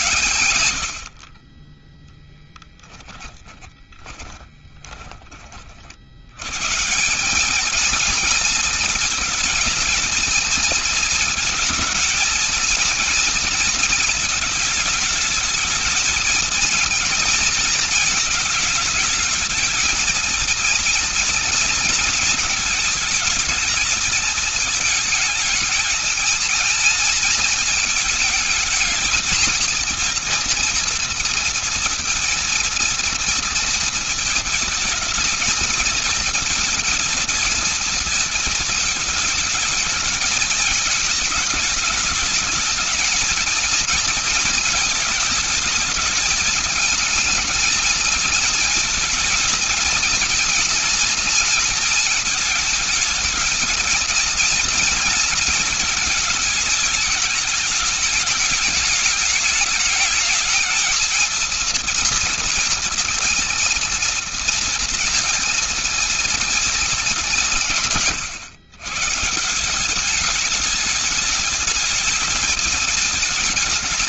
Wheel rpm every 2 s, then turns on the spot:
70, 10, 30, 190, 230, 230, 230, 220, 230, 210, 230, 220, 220, 220, 220, 230, 230, 230, 230, 220, 210, 230, 220, 220, 230, 230, 220, 220, 210, 210, 230, 230, 230, 180, 170, 210, 220.
2-4